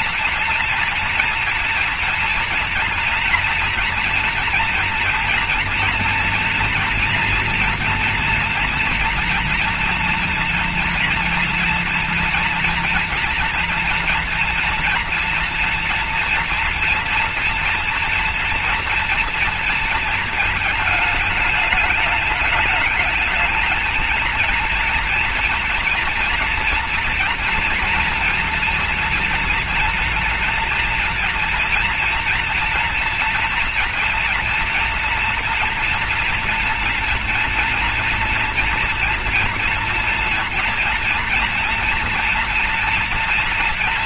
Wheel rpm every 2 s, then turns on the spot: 230, 240, 230, 230, 230, 230, 230, 230, 230, 230, 220, 210, 230, 230, 230, 230, 240, 230, 230, 230, 230, 240.
none